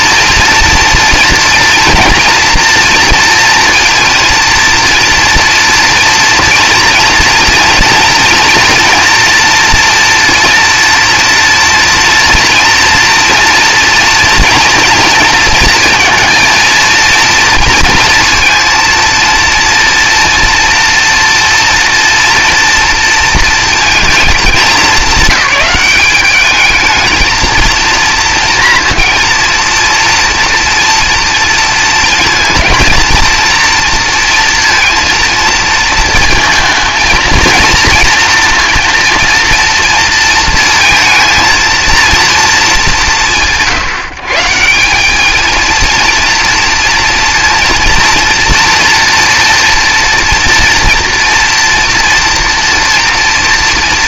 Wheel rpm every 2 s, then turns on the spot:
240, 230, 230, 230, 230, 230, 230, 230, 230, 230, 230, 230, 200, 220, 230, 230, 230, 230, 230, 230, 230, 200, 180, 230, 240, 230, 230.
none